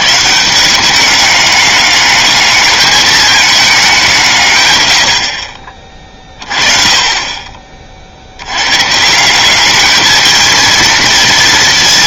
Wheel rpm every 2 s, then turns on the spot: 160, 210, 140, 30, 100, 220.
none